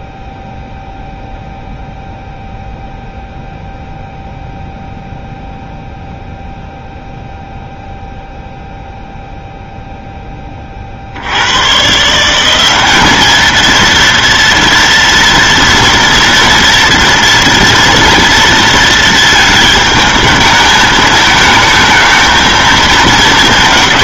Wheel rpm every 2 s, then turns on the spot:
0, 0, 0, 0, 0, 20, 180, 230, 230, 230, 220, 220.
none